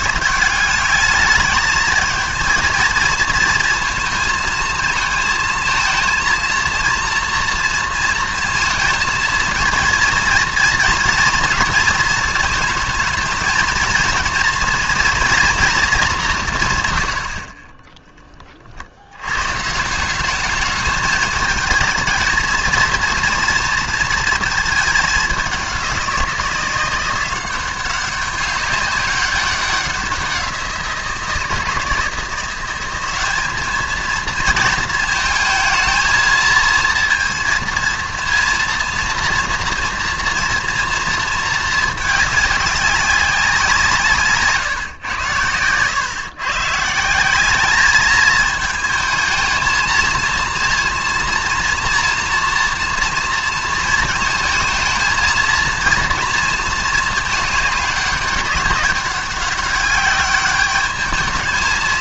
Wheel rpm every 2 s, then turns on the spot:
190, 230, 220, 230, 230, 230, 220, 230, 150, 40, 210, 230, 220, 180, 200, 180, 180, 230, 230, 230, 230, 200, 140, 140, 220, 230, 230, 230, 230, 200, 210.
none